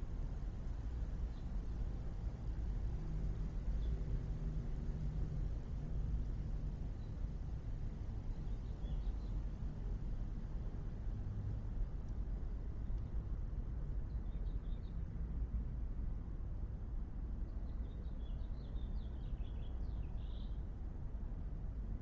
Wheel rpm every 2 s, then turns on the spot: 0, 0, 0, 0, 0, 0, 0, 0, 0, 0, 0.
none